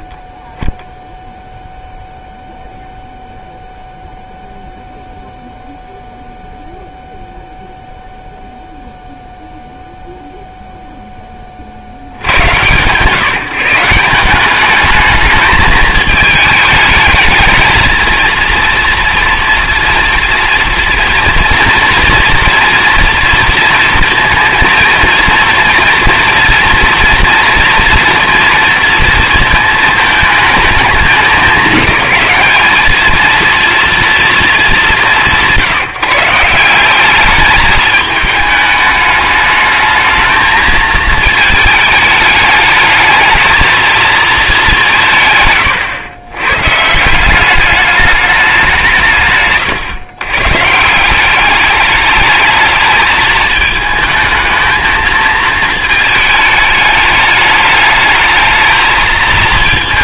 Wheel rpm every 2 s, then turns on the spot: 20, 0, 0, 0, 0, 0, 120, 210, 210, 230, 230, 230, 230, 230, 230, 220, 220, 180, 170, 210, 220, 220, 200, 140, 180, 150, 220, 220, 210, 220.
none